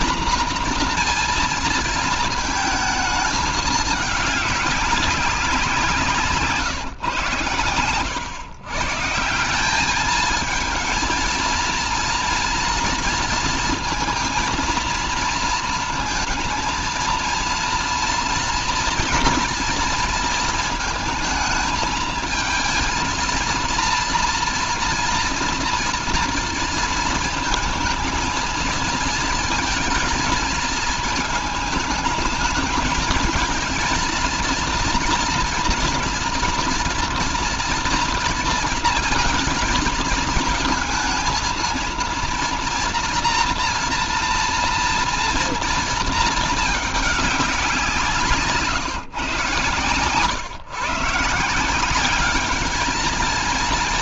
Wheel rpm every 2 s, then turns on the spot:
240, 220, 200, 140, 130, 220, 230, 230, 230, 240, 230, 220, 230, 230, 220, 220, 220, 240, 230, 230, 220, 230, 230, 220, 160, 130, 210.
none